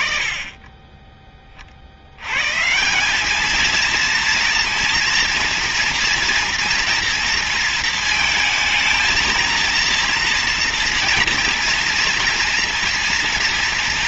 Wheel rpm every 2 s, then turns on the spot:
40, 220, 230, 230, 230, 230, 230.
none